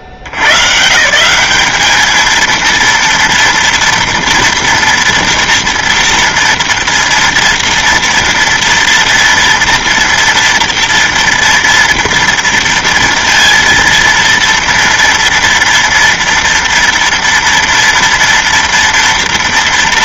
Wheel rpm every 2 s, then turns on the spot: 70, 230, 230, 230, 230, 230, 230, 230, 230, 230.
none